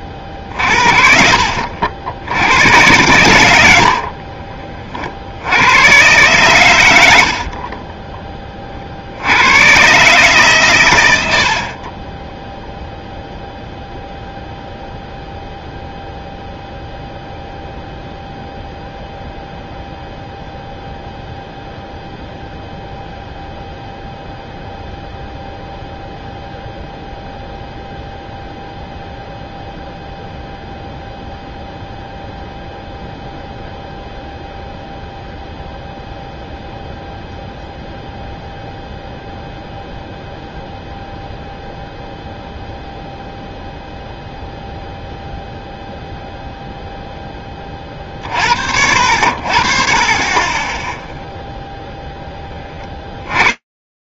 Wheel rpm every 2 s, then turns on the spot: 50, 90, 40, 110, 20, 130, 10, 0, 0, 0, 0, 0, 0, 0, 0, 0, 0, 0, 0, 0, 0, 0, 0, 0, 50, 30, 20.
4-6 12-14 52-54